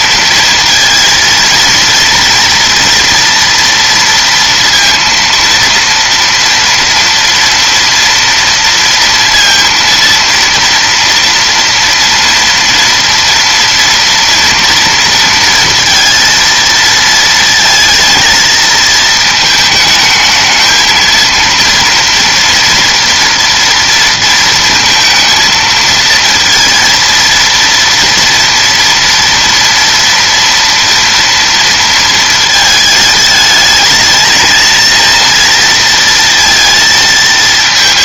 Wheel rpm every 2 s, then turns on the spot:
230, 230, 230, 230, 230, 230, 230, 230, 230, 220, 230, 230, 220, 230, 230, 230, 220, 230, 220.
none